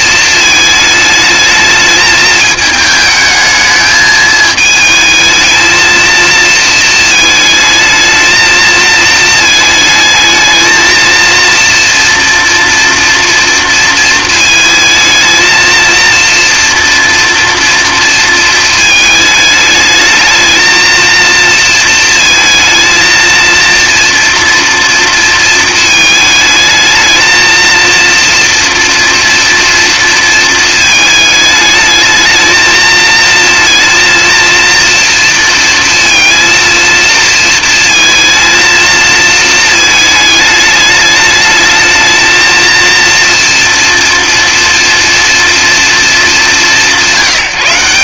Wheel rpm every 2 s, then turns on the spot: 220, 220, 220, 220, 220, 220, 240, 230, 230, 220, 230, 220, 230, 220, 230, 220, 220, 230, 230, 220, 220, 230, 230, 190.
none